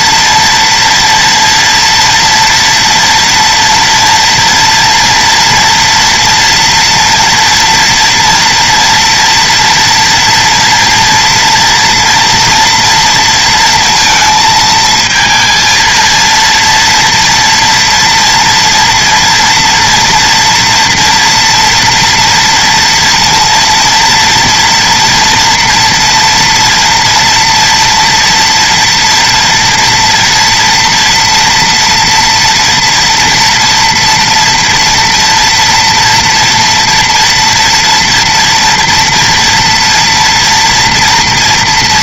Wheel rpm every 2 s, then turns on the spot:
230, 230, 230, 240, 230, 230, 230, 230, 230, 230, 230, 230, 230, 230, 230, 230, 240, 240, 230, 230, 230.
none